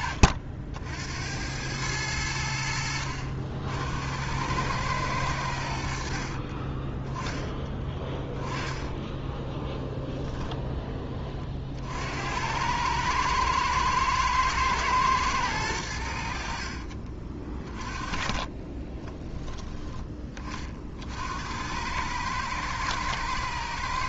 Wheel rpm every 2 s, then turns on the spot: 60, 80, 110, 20, 10, 10, 100, 120, 50, 30, 40, 110.
6-10 16-20